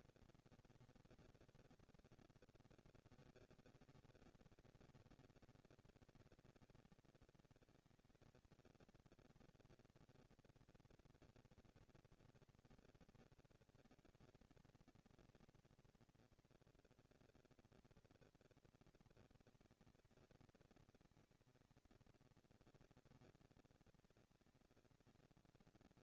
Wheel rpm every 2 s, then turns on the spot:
230, 220, 200, 200, 220, 230, 230, 220, 230, 230, 220, 230, 230.
none